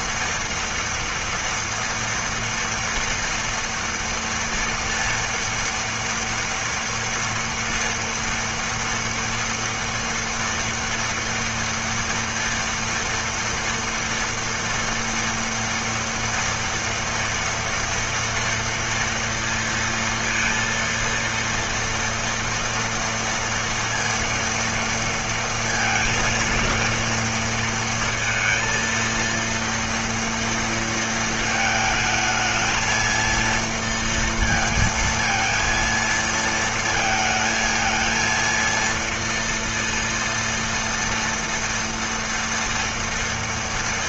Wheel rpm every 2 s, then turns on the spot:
230, 230, 230, 230, 230, 230, 230, 240, 230, 230, 230, 230, 230, 230, 230, 230, 220, 230, 230, 230, 230, 240.
none